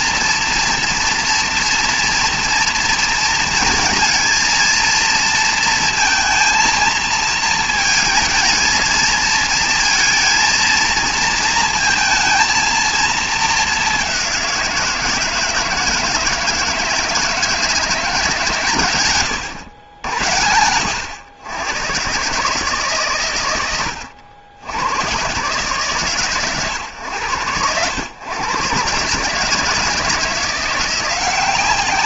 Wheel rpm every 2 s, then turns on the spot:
230, 230, 230, 220, 220, 230, 230, 180, 160, 130, 110, 140, 90, 130, 120, 170.
none